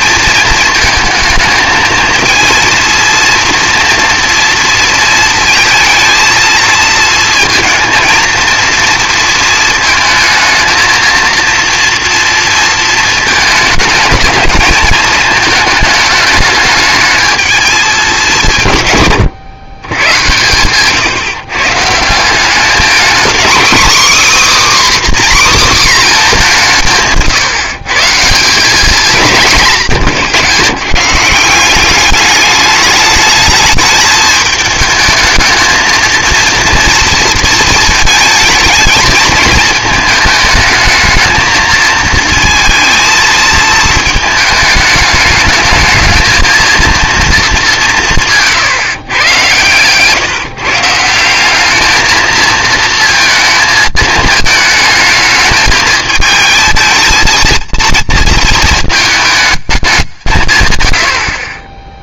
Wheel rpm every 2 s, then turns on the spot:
220, 230, 230, 230, 230, 220, 230, 220, 210, 150, 130, 220, 290, 180, 200, 140, 210, 220, 230, 220, 220, 230, 210, 230, 150, 150, 230, 220, 220, 220, 110.
none